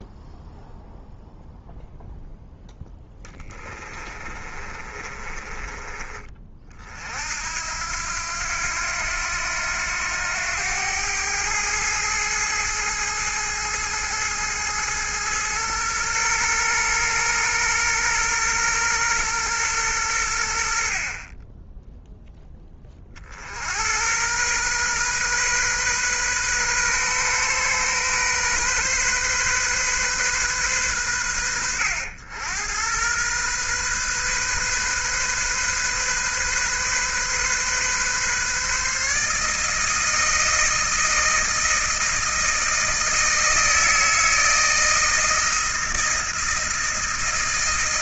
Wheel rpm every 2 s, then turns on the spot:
0, 10, 30, 40, 90, 100, 110, 110, 120, 120, 60, 20, 120, 130, 130, 110, 100, 130, 130, 140, 160, 160, 160, 160.
4-6